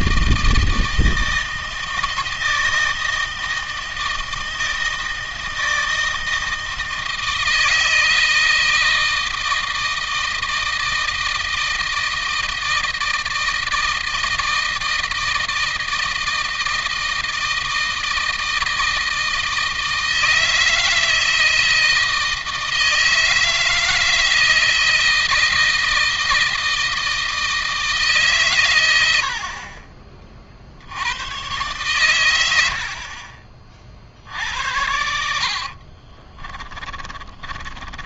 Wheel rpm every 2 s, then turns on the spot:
160, 160, 160, 160, 160, 160, 160, 160, 160, 160, 160, 160, 160, 160, 100, 90, 70, 70, 20.
34-38